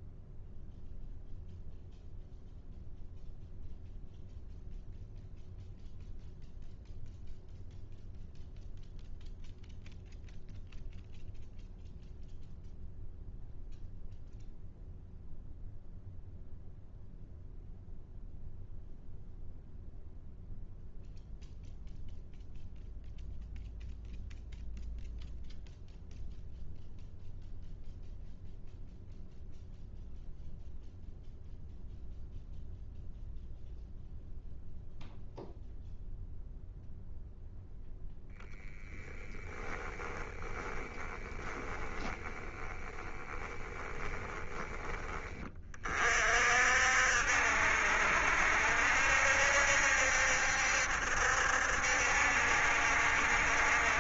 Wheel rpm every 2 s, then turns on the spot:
0, 0, 0, 0, 0, 0, 0, 0, 0, 0, 0, 0, 0, 0, 0, 0, 0, 0, 0, 10, 10, 10, 10, 60, 70, 70, 70.
42-44